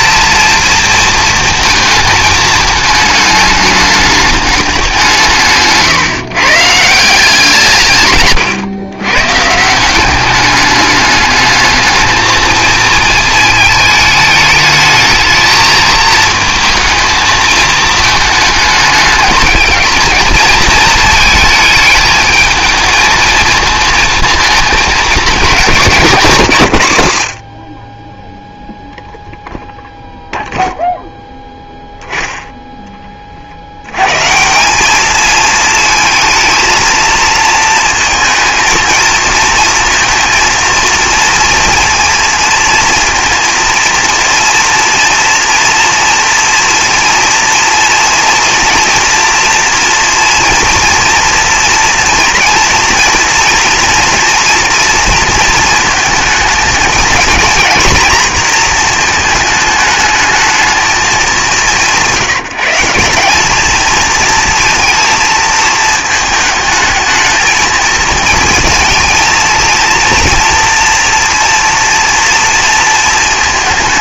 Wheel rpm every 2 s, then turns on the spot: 230, 220, 200, 160, 110, 200, 220, 210, 220, 210, 220, 220, 220, 120, 0, 0, 10, 170, 220, 230, 230, 230, 230, 230, 240, 240, 230, 230, 220, 230, 220, 170, 230, 220, 230, 230, 230.
none